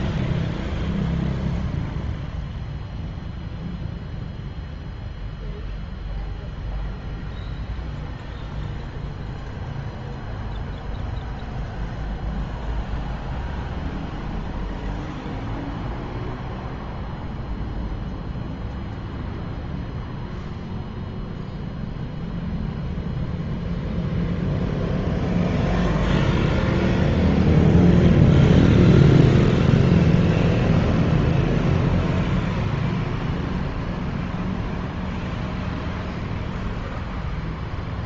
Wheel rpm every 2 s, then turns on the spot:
0, 0, 0, 0, 0, 0, 0, 0, 0, 0, 0, 0, 0, 0, 0, 0, 0, 0, 0.
none